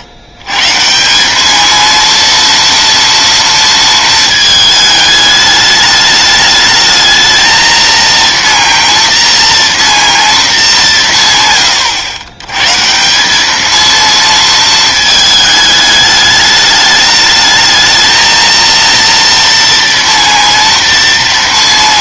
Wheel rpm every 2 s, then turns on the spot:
150, 230, 210, 220, 230, 200, 140, 220, 210, 230, 230.
none